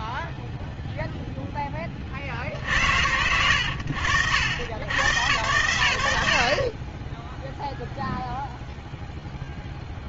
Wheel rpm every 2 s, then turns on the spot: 0, 80, 100, 0, 10.
none